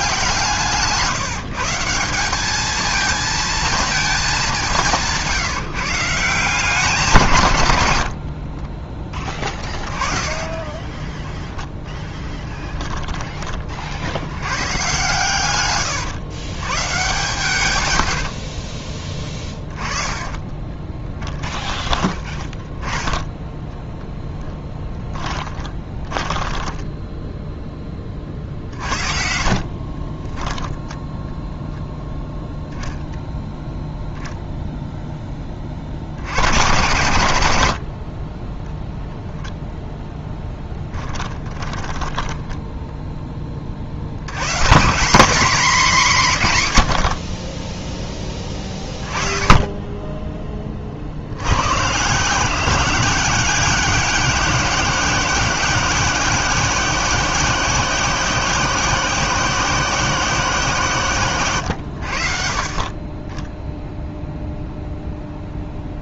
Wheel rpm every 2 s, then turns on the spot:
160, 210, 200, 180, 50, 10, 10, 100, 120, 30, 10, 20, 10, 10, 50, 10, 0, 0, 100, 10, 10, 10, 150, 120, 20, 30, 170, 190, 190, 180, 160, 50, 0.
8-14 18-22 24-30 40-44 48-50